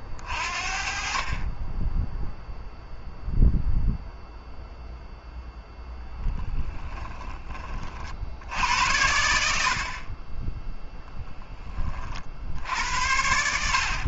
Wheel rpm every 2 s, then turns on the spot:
20, 10, 0, 0, 50, 40, 40.
none